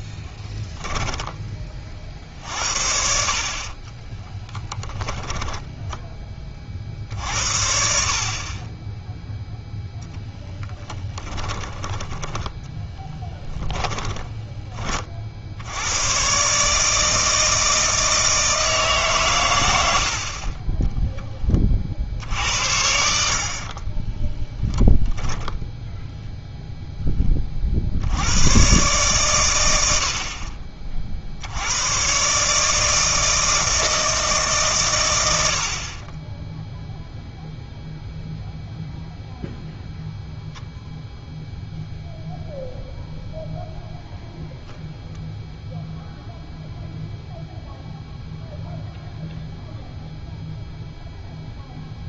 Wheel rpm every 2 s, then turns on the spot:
10, 50, 10, 50, 10, 10, 10, 30, 150, 150, 20, 80, 10, 0, 130, 40, 150, 120, 0, 0, 0, 0, 0, 0, 0, 0.
0-2 4-6 10-12